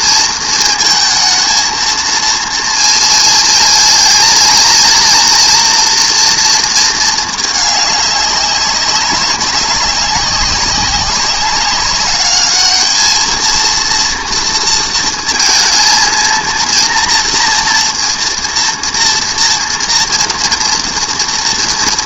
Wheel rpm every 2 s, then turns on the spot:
220, 230, 230, 220, 200, 190, 210, 230, 230, 230, 230.
none